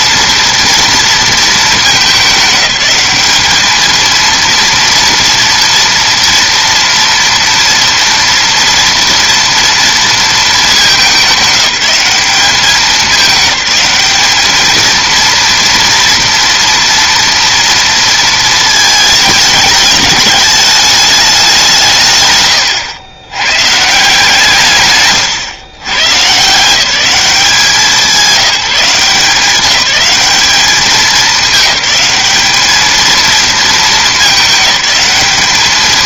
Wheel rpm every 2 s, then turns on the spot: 230, 200, 230, 230, 230, 210, 190, 220, 230, 220, 210, 110, 140, 170, 180, 200, 210, 210.
none